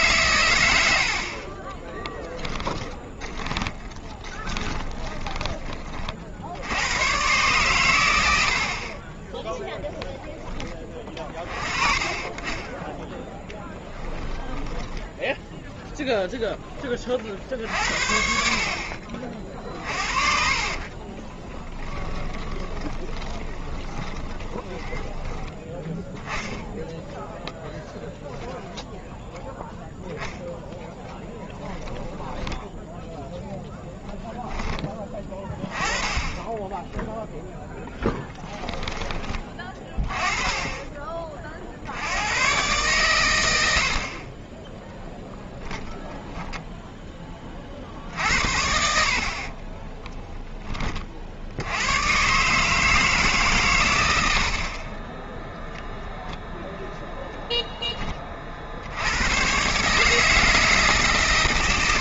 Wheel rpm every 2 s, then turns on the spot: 100, 10, 20, 90, 50, 10, 20, 10, 20, 40, 40, 20, 20, 10, 0, 0, 10, 10, 10, 10, 20, 110, 10, 10, 50, 40, 160, 20, 0, 90, 150.
2-6 12-16 20-26 36-38 44-46